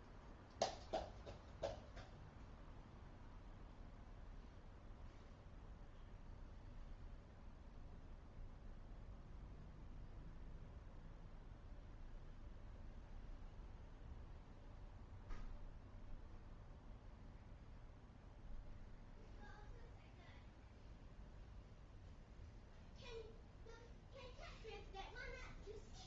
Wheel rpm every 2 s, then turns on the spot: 0, 0, 0, 0, 0, 0, 0, 0, 0, 0, 0, 0, 0.
none